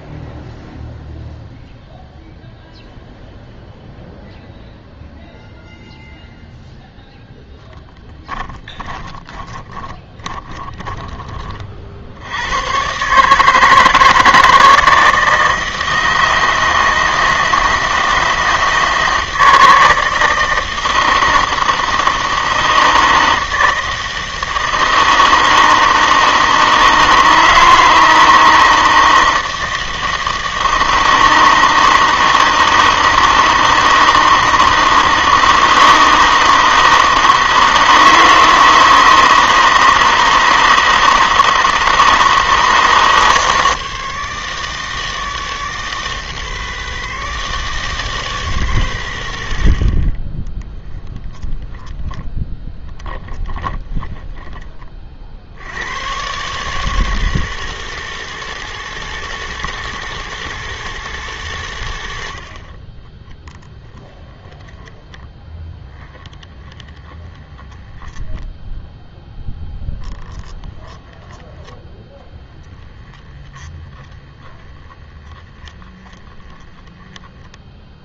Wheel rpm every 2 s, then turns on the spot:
0, 0, 0, 0, 20, 20, 110, 160, 160, 160, 160, 160, 160, 160, 160, 160, 160, 160, 160, 160, 160, 160, 160, 160, 150, 30, 10, 30, 150, 160, 160, 50, 10, 20, 10, 10, 10, 20, 10.
8-12 50-54 64-68 70-78